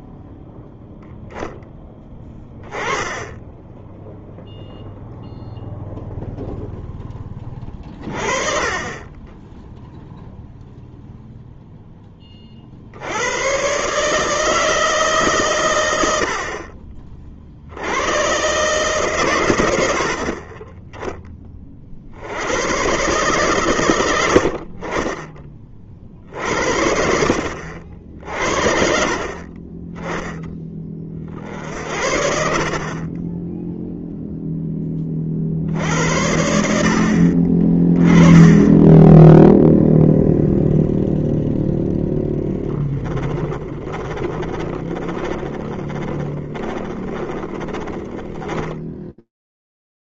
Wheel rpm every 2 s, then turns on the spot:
0, 10, 0, 0, 30, 0, 40, 160, 50, 130, 40, 90, 70, 50, 50, 10, 50, 0, 80, 10, 0, 10, 20, 20, 10.
42-50